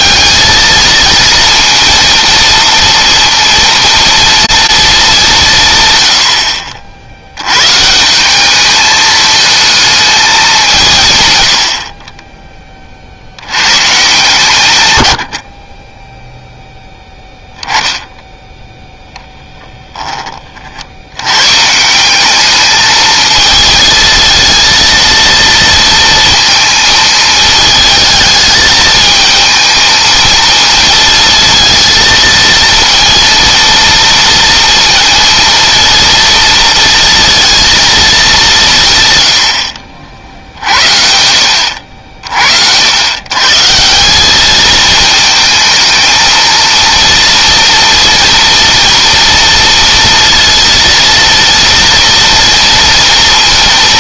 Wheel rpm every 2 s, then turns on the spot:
230, 230, 220, 70, 210, 160, 30, 120, 0, 0, 60, 220, 230, 220, 220, 220, 230, 230, 230, 170, 60, 80, 220, 230, 230, 230, 230.
none